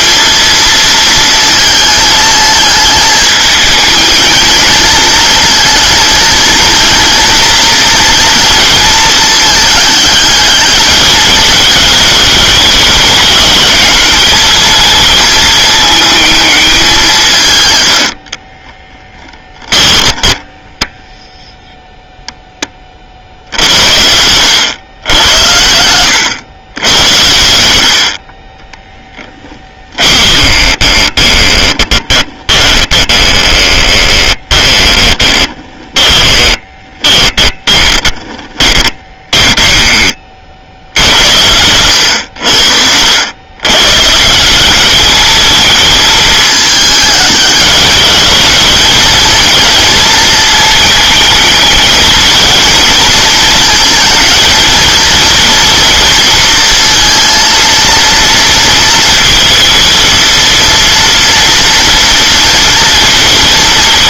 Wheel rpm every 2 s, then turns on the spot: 230, 220, 220, 230, 230, 210, 210, 220, 210, 20, 0, 20, 100, 100, 20, 20, 20, 30, 20, 20, 60, 80, 190, 210, 210, 220, 220, 230, 230, 230, 230, 230.
18-20 28-40 42-44